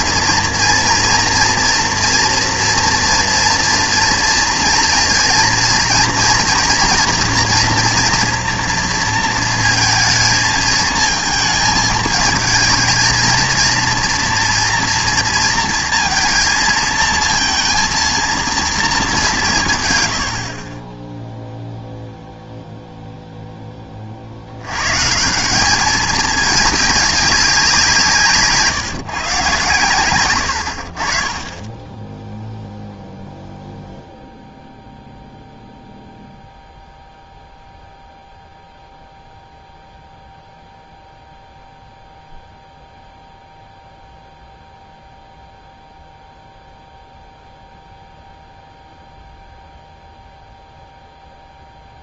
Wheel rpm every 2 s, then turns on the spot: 230, 240, 230, 230, 230, 220, 220, 230, 230, 230, 40, 0, 110, 210, 160, 70, 0, 0, 0, 0, 0, 0, 0, 0, 0, 0.
none